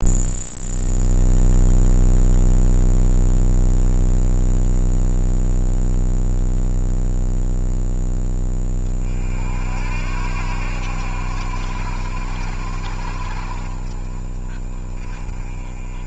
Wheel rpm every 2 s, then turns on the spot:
0, 0, 0, 0, 30, 80, 70, 30.
none